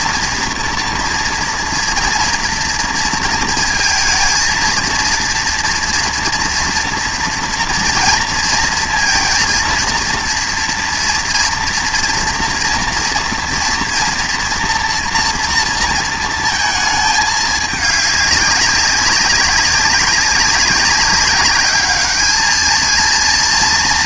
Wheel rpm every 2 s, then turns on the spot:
230, 230, 230, 230, 230, 230, 230, 230, 230, 200, 200, 220.
none